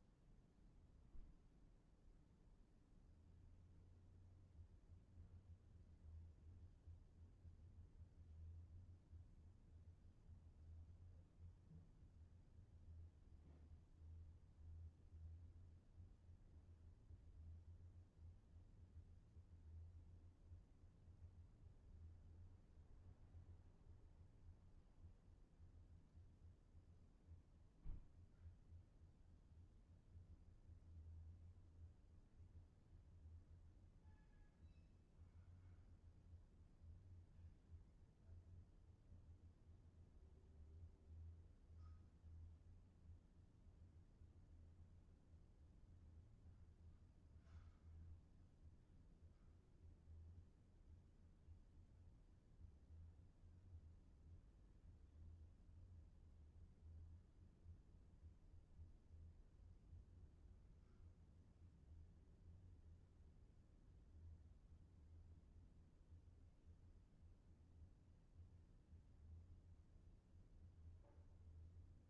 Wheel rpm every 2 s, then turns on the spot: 0, 0, 0, 0, 0, 0, 0, 0, 0, 0, 0, 0, 0, 0, 0, 0, 0, 0, 0, 0, 0, 0, 0, 0, 0, 0, 0, 0, 0, 0, 0, 0, 0, 0, 0, 0.
none